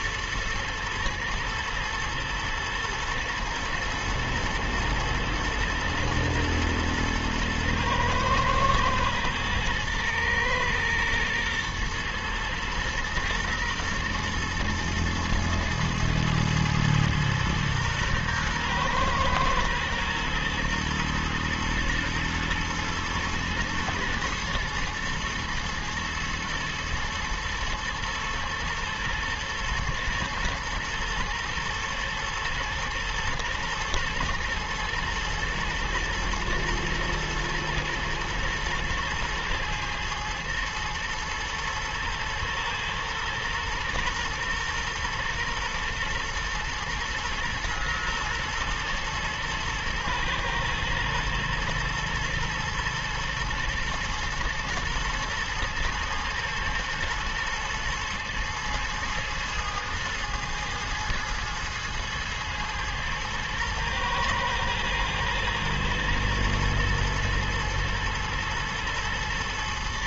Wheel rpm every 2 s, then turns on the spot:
110, 120, 110, 110, 110, 110, 120, 110, 110, 120, 120, 110, 120, 110, 110, 120, 120, 110, 110, 110, 110, 120, 120, 120, 120, 110, 110, 110, 110, 110, 110, 110, 110, 110, 120.
none